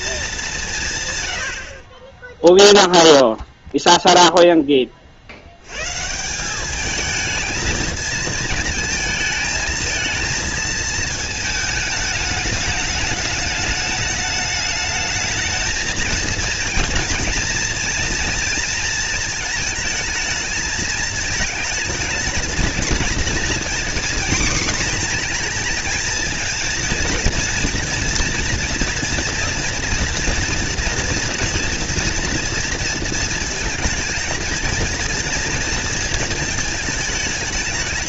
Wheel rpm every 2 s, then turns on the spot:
150, 0, 20, 210, 220, 220, 210, 220, 240, 230, 220, 230, 230, 230, 230, 240, 230, 230, 220.
none